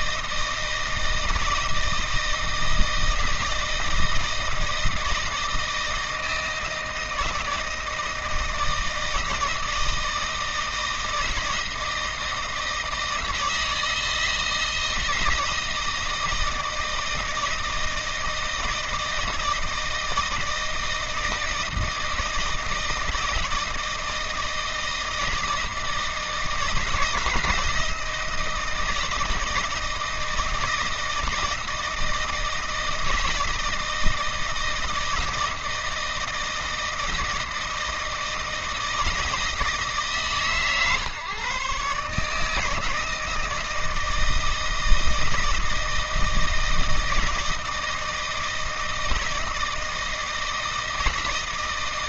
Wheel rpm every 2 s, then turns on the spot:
160, 160, 160, 160, 160, 160, 160, 160, 160, 160, 160, 160, 160, 160, 170, 160, 160, 160, 160, 160, 150, 160, 160, 160, 160, 160.
none